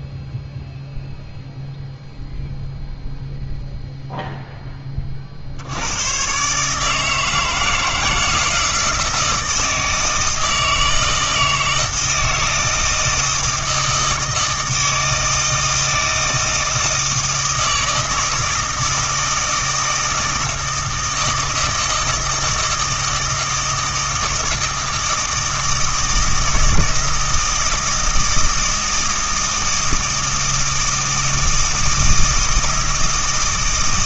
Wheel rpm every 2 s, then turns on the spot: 0, 0, 10, 150, 160, 160, 160, 160, 160, 160, 160, 160, 160, 160, 160, 160, 160.
none